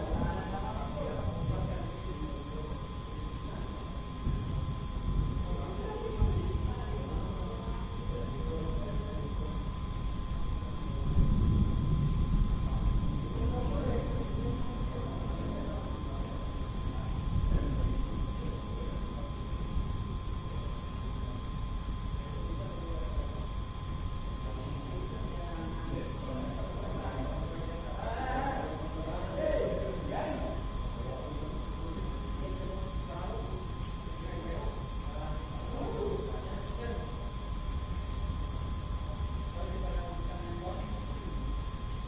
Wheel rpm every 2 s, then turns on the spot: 0, 0, 0, 0, 0, 0, 0, 0, 0, 0, 0, 0, 0, 0, 0, 0, 0, 0, 0, 0, 0.
none